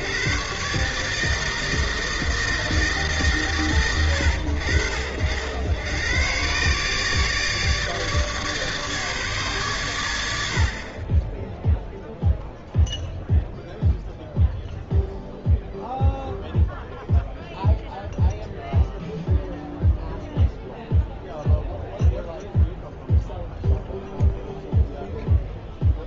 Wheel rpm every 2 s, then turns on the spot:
140, 150, 70, 130, 150, 50, 0, 0, 0, 0, 0, 0, 0.
none